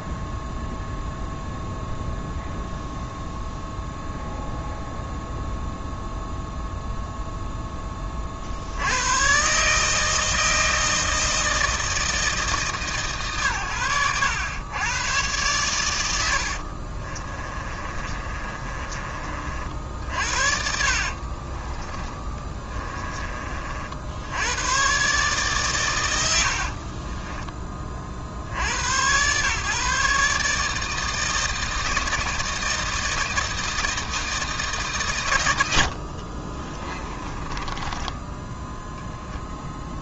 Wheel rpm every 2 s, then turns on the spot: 0, 0, 0, 0, 90, 160, 150, 100, 60, 30, 60, 20, 120, 50, 90, 150, 160, 150, 30, 0.
16-24 26-28 36-38